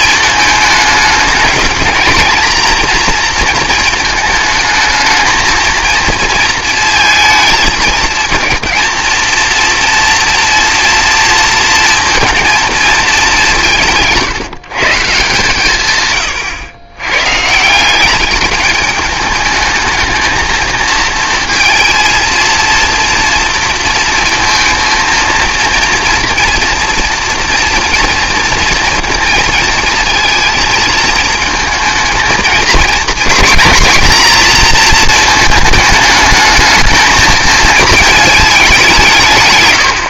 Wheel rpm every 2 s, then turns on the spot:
220, 230, 220, 230, 230, 240, 230, 160, 110, 210, 230, 230, 230, 230, 230, 220, 220, 230, 220, 190.
none